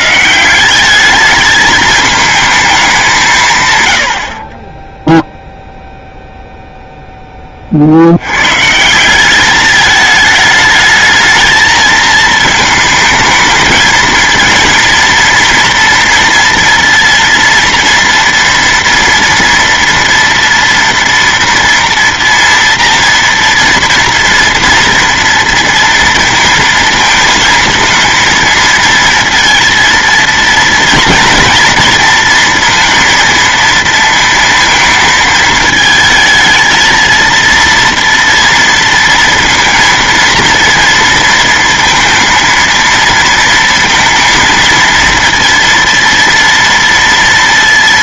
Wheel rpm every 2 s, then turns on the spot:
200, 210, 20, 0, 170, 220, 220, 230, 230, 230, 230, 240, 230, 230, 230, 230, 230, 230, 220, 230, 230, 230, 230, 230.
none